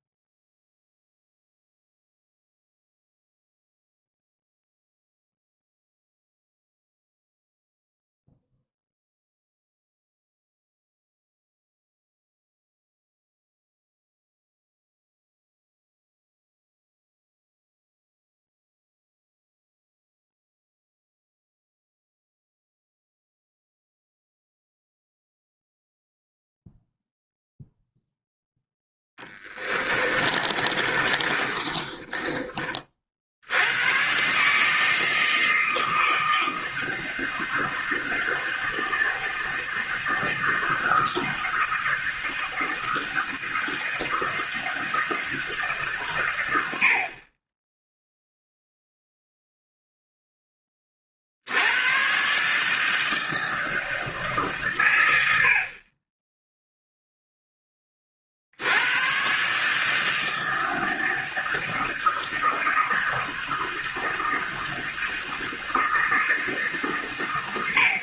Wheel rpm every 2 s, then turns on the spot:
0, 0, 0, 0, 0, 0, 0, 0, 0, 0, 0, 0, 0, 0, 0, 30, 30, 150, 160, 160, 160, 160, 160, 80, 0, 10, 140, 140, 0, 80, 160, 160, 160, 150.
30-32